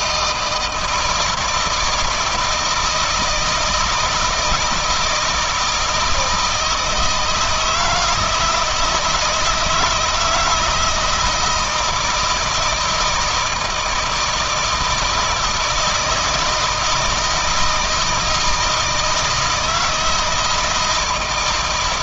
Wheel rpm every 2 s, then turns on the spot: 160, 160, 170, 160, 160, 160, 160, 160, 160, 160, 160.
none